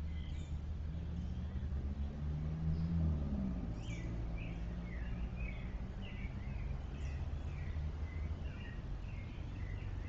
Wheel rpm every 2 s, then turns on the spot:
0, 0, 0, 0, 0.
none